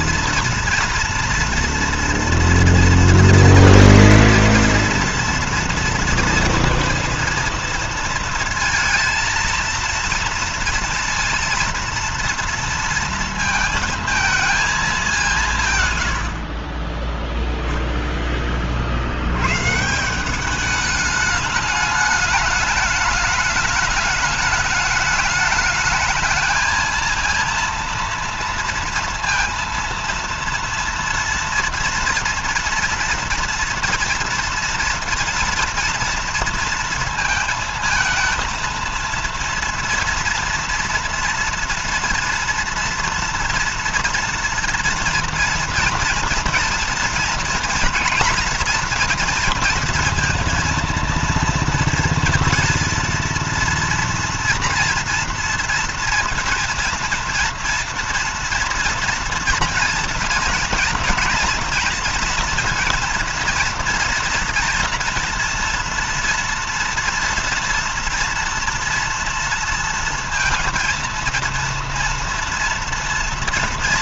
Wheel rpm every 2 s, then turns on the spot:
230, 240, 230, 230, 230, 230, 230, 220, 60, 30, 190, 210, 210, 220, 230, 230, 230, 230, 230, 230, 230, 240, 230, 240, 230, 230, 230, 230, 230, 230, 230, 230, 240, 230, 230, 230, 230.
16-18